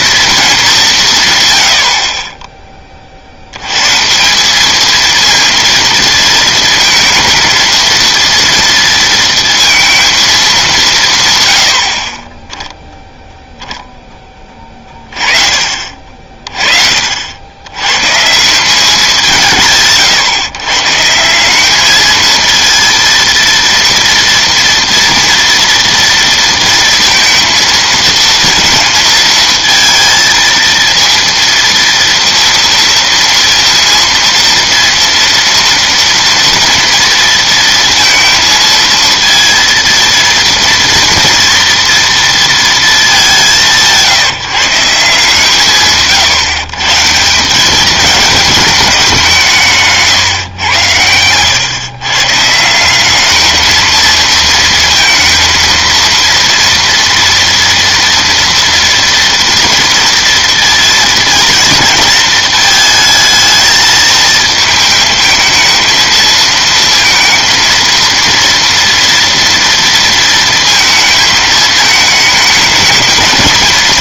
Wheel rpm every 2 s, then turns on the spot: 200, 20, 210, 230, 230, 190, 0, 20, 40, 180, 140, 230, 240, 230, 230, 230, 230, 230, 230, 230, 230, 230, 170, 150, 210, 110, 160, 230, 230, 230, 240, 220, 220, 230, 230, 230, 220.
none